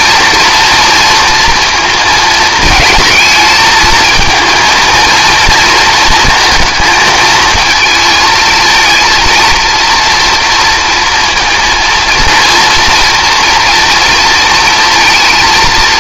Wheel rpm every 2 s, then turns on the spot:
230, 230, 230, 230, 230, 230, 240, 230.
none